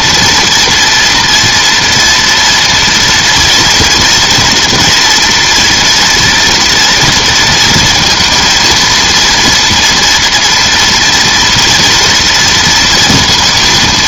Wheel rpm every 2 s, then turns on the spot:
240, 230, 240, 230, 230, 230, 230.
none